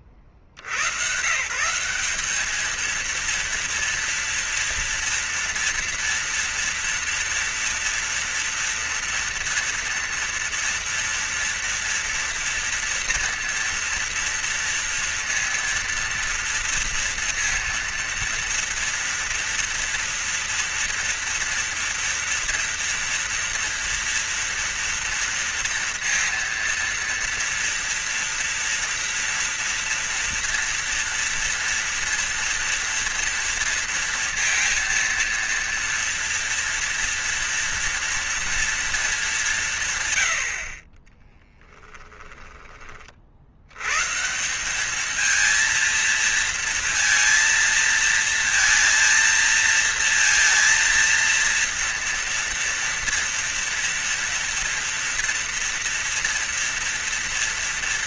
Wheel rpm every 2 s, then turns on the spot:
50, 220, 230, 230, 230, 230, 230, 230, 230, 230, 230, 240, 230, 230, 230, 230, 230, 230, 230, 230, 60, 30, 200, 230, 230, 230, 240, 230, 230.
none